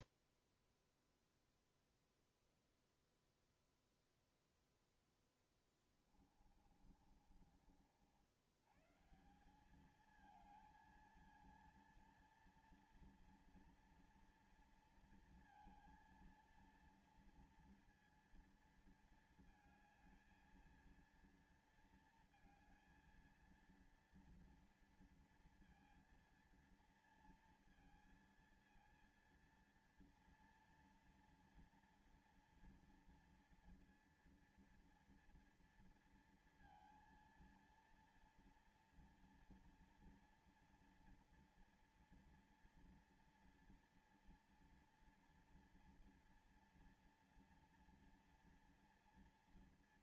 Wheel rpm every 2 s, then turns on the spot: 0, 0, 0, 30, 120, 220, 230, 230, 230, 230, 230, 230, 230, 230, 230, 230, 230, 230, 230, 230, 230, 240, 240, 230, 230.
6-8